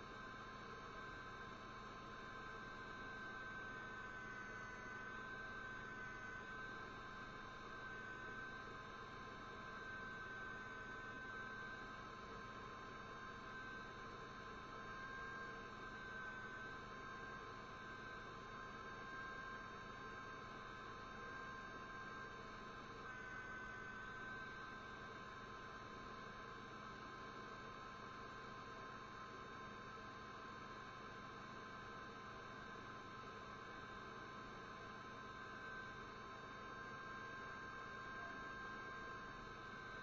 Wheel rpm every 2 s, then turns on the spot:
0, 0, 0, 0, 0, 0, 0, 0, 0, 0, 0, 0, 0, 0, 0, 0, 0, 0, 0, 0.
none